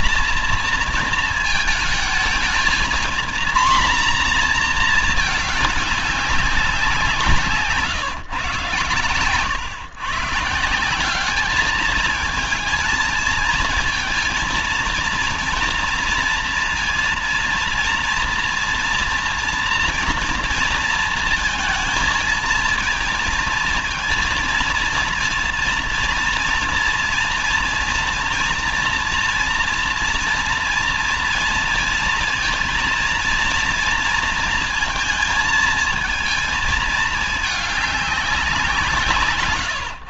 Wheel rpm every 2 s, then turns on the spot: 230, 230, 230, 190, 140, 160, 220, 230, 230, 230, 230, 220, 230, 230, 230, 230, 230, 230, 220, 180.
none